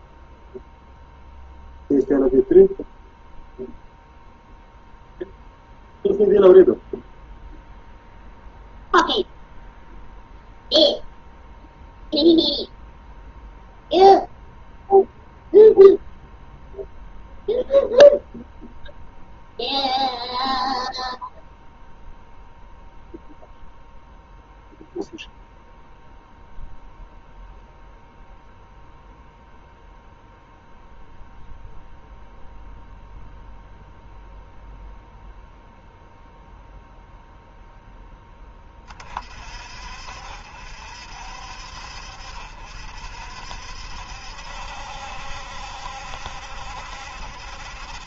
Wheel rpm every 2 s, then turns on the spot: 0, 0, 0, 0, 0, 0, 0, 0, 0, 0, 0, 0, 0, 0, 0, 0, 0, 0, 0, 30, 60, 60, 70, 70.
none